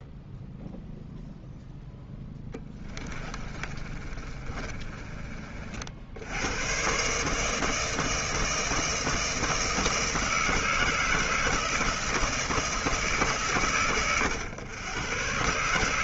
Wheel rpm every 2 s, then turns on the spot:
0, 10, 30, 90, 160, 160, 160, 110.
2-6